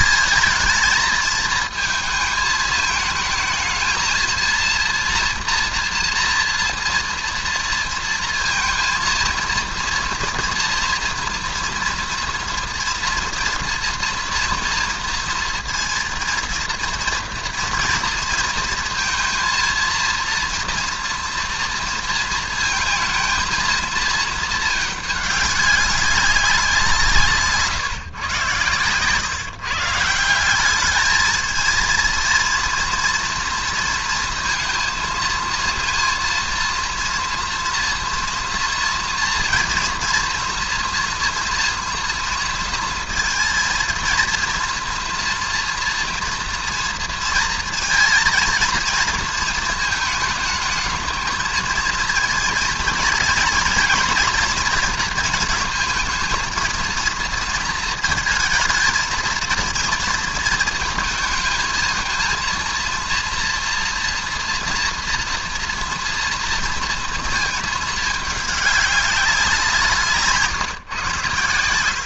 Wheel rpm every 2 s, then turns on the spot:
220, 220, 230, 230, 230, 230, 230, 230, 230, 230, 230, 220, 220, 190, 120, 190, 230, 230, 230, 230, 230, 230, 230, 240, 230, 210, 230, 240, 220, 230, 230, 230, 230, 230, 210, 140.
none